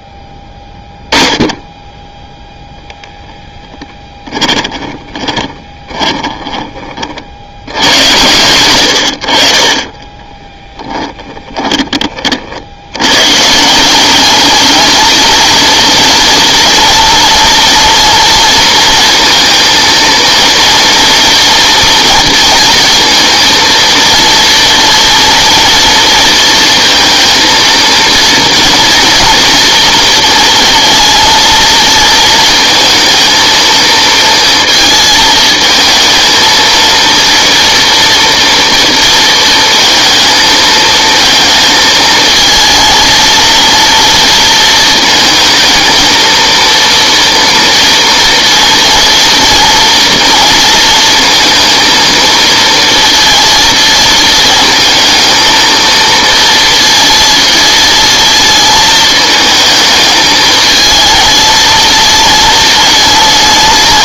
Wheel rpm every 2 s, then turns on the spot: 10, 0, 20, 20, 100, 10, 80, 220, 230, 230, 230, 230, 230, 230, 230, 230, 230, 230, 230, 230, 220, 230, 230, 230, 240, 230, 230, 220, 230, 230, 220, 220.
4-8 10-12